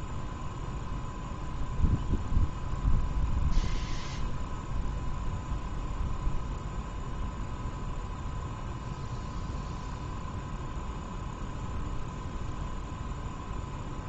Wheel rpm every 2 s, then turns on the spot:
0, 0, 0, 0, 0, 0, 0.
none